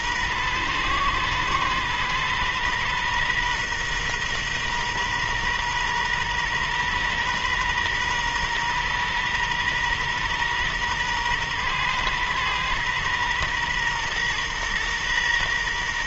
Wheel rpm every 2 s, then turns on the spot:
120, 120, 120, 120, 120, 120, 120, 120.
none